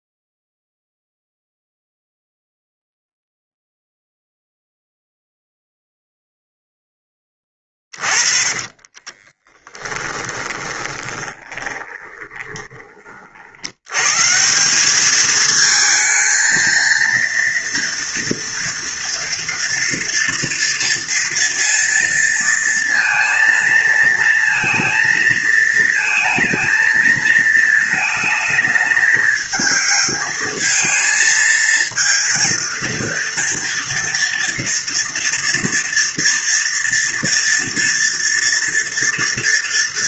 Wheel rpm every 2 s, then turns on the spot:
0, 0, 0, 0, 30, 20, 10, 140, 220, 230, 230, 230, 230, 220, 220, 220, 220, 230, 230, 230.
8-14